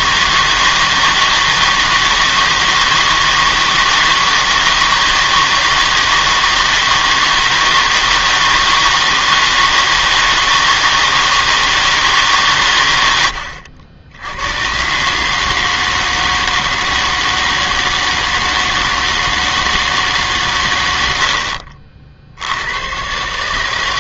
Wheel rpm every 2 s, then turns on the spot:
160, 160, 160, 160, 160, 160, 130, 110, 160, 160, 120, 90.
none